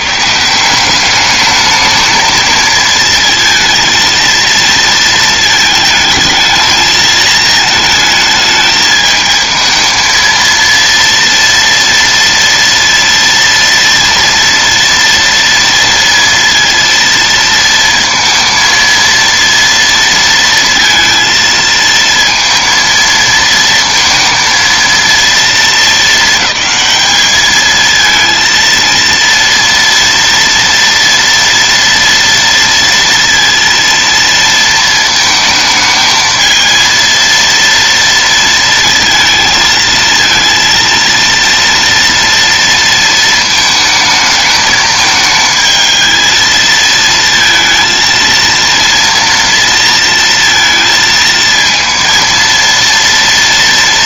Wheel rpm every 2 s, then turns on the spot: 160, 220, 230, 220, 220, 230, 230, 230, 230, 230, 230, 230, 230, 220, 230, 230, 230, 230, 220, 230, 230, 230, 220, 220, 230, 230, 230.
none